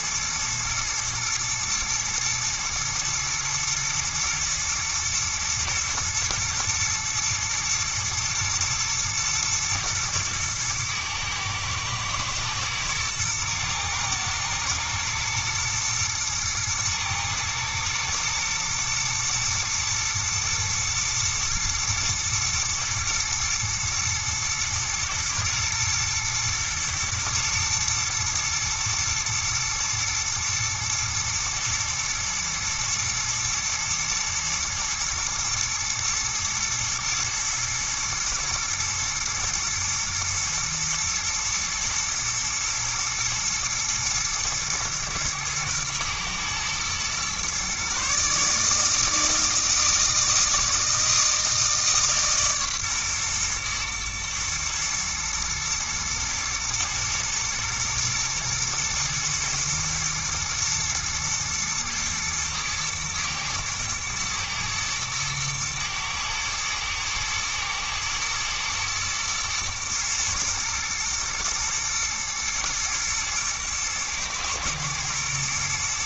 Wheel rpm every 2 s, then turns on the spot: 110, 110, 110, 120, 110, 110, 110, 110, 110, 120, 120, 110, 110, 120, 110, 120, 110, 110, 120, 110, 120, 110, 110, 120, 150, 160, 130, 120, 110, 120, 120, 110, 110, 110, 110, 110, 110, 110.
none